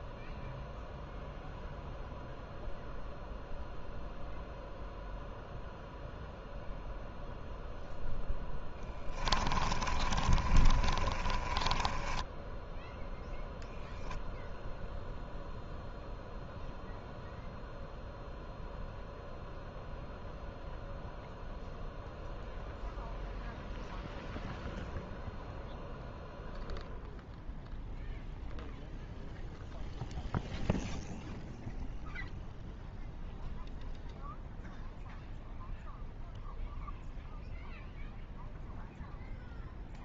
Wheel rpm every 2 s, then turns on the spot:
0, 0, 0, 0, 10, 30, 10, 0, 0, 0, 0, 0, 0, 0, 0, 0, 0, 0, 0, 0.
8-14